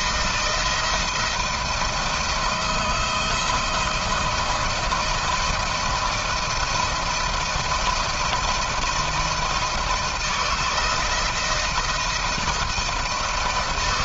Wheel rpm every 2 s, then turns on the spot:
160, 160, 170, 170, 170, 160, 170.
none